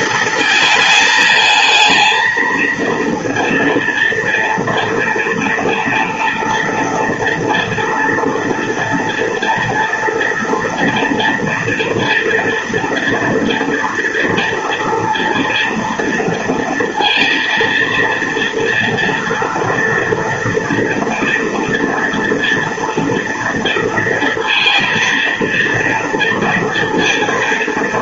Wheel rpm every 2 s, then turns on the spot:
220, 230, 240, 230, 230, 230, 230, 230, 230, 240, 230, 230, 230, 230.
none